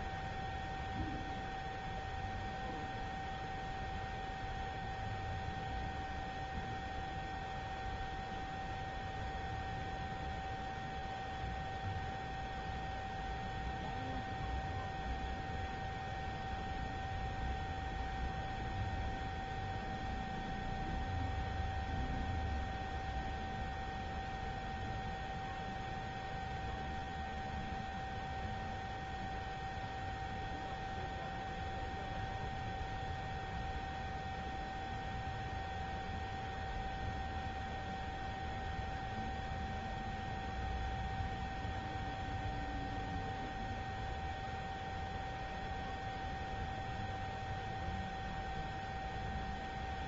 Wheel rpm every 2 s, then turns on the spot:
0, 0, 0, 0, 0, 0, 0, 0, 0, 0, 0, 0, 0, 0, 0, 0, 0, 0, 0, 0, 0, 0, 0, 0, 0.
none